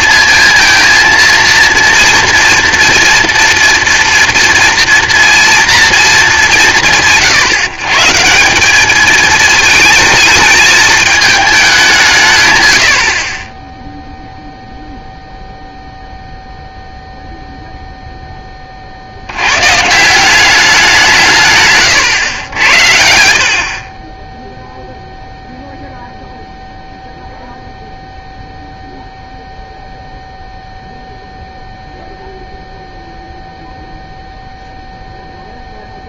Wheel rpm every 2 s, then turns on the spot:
230, 230, 230, 210, 170, 220, 140, 0, 0, 20, 190, 90, 0, 0, 0, 0, 0, 0.
none